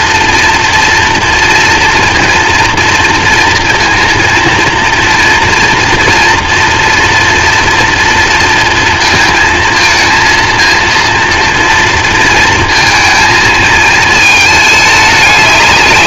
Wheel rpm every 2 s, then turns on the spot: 230, 230, 230, 240, 230, 230, 230, 210.
none